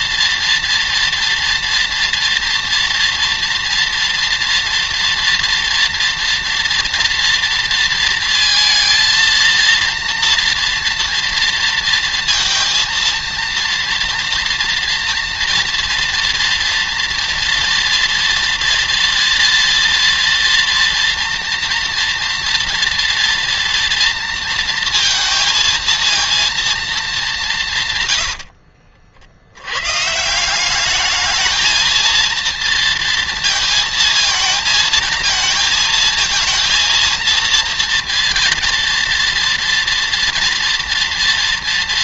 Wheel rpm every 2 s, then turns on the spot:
230, 230, 240, 230, 220, 230, 230, 230, 230, 230, 230, 230, 230, 230, 70, 190, 230, 220, 220, 230, 230.
28-30